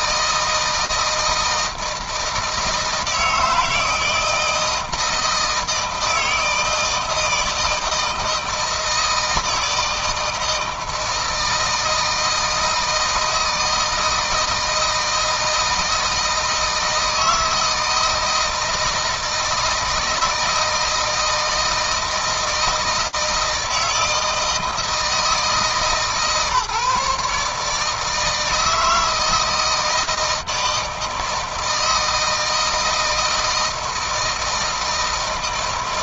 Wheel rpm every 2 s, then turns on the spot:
160, 160, 160, 160, 160, 160, 160, 160, 160, 160, 160, 160, 160, 150, 160, 160, 160, 160.
none